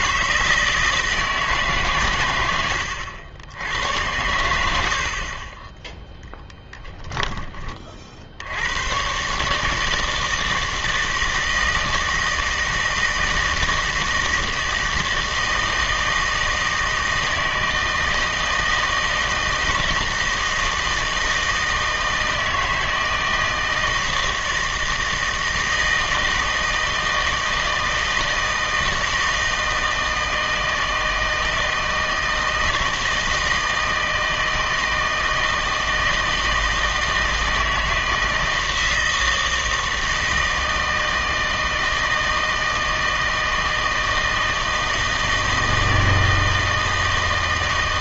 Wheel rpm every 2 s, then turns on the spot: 160, 90, 90, 10, 90, 160, 160, 160, 160, 160, 160, 160, 160, 160, 160, 160, 160, 160, 160, 160, 160, 160, 160, 160.
4-8